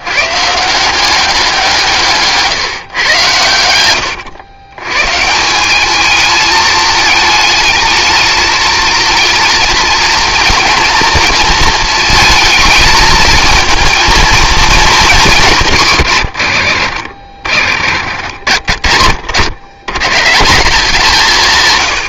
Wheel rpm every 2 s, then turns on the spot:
150, 150, 100, 220, 220, 230, 220, 220, 70, 50, 170.
none